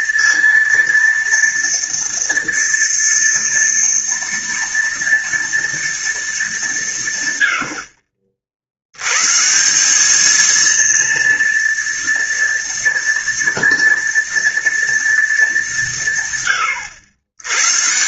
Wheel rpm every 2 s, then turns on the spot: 230, 230, 230, 210, 70, 230, 240, 230, 120.
none